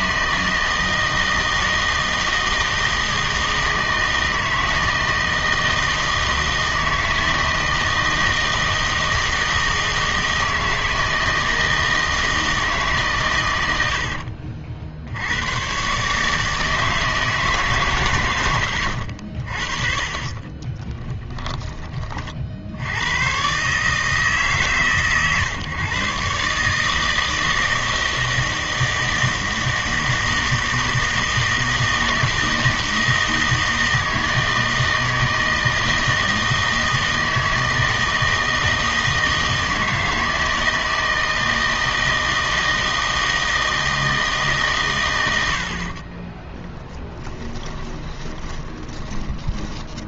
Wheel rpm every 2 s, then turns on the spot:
160, 160, 160, 160, 160, 160, 160, 60, 160, 100, 30, 70, 140, 140, 160, 160, 160, 160, 160, 160, 160, 160, 140, 20, 20.
20-22 46-50